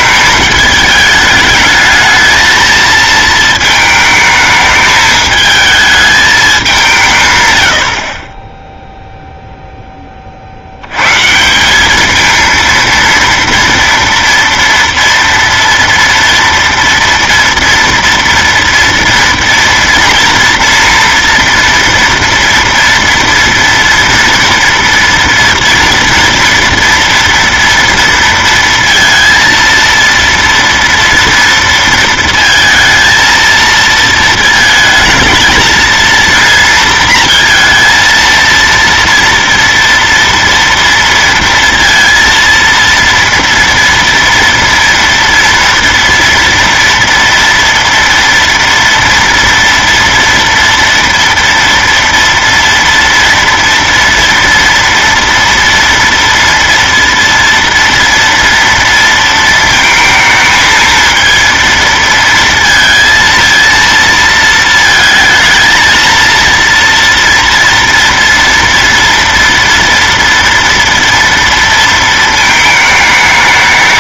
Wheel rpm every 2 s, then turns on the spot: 210, 220, 210, 200, 10, 80, 230, 230, 230, 230, 230, 230, 230, 240, 230, 230, 230, 220, 230, 230, 230, 230, 230, 230, 230, 230, 230, 230, 230, 230, 220, 230, 220, 230, 230, 230, 220.
none